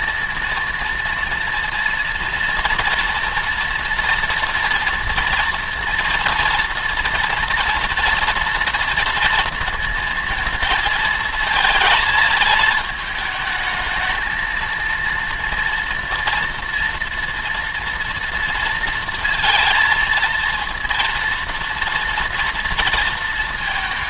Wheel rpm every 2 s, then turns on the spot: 230, 240, 230, 230, 230, 230, 220, 220, 230, 230, 230, 230.
none